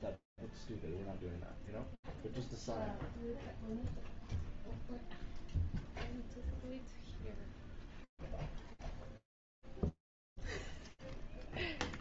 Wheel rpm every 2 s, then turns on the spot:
0, 0, 0, 0, 0, 0.
none